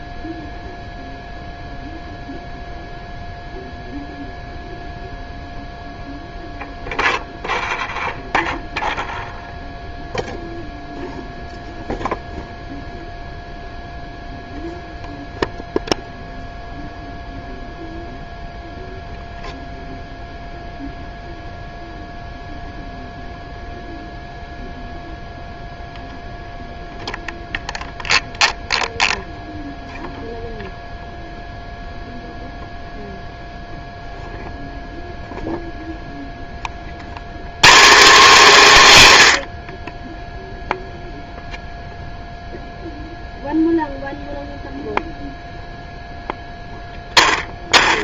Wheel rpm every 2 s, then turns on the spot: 0, 0, 0, 0, 0, 0, 0, 0, 0, 0, 0, 0, 0, 0, 0, 0, 0, 0, 30, 190, 0, 0, 0, 10.
none